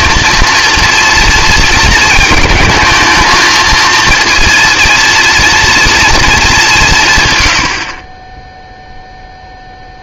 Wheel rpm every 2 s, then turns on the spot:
230, 220, 240, 180, 0.
none